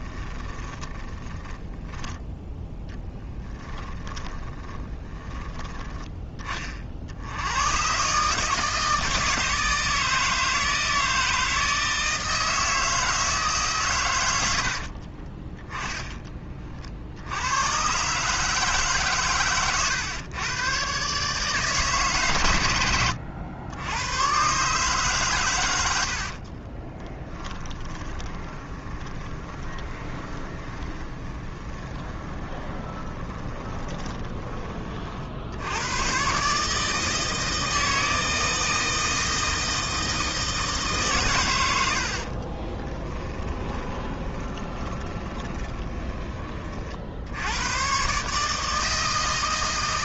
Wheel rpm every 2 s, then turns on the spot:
10, 10, 20, 30, 160, 160, 160, 50, 60, 140, 130, 90, 140, 20, 20, 10, 20, 30, 150, 160, 150, 20, 20, 40, 160.
0-2 4-6 14-16 26-34 42-46